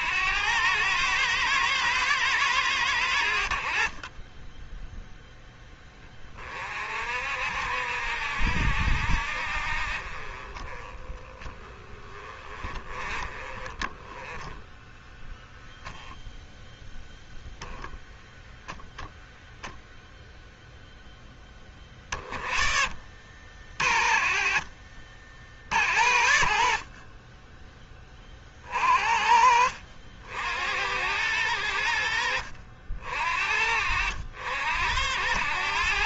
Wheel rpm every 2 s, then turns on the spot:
100, 100, 10, 50, 70, 20, 30, 10, 0, 0, 0, 40, 50, 40, 40, 70, 50, 80.
none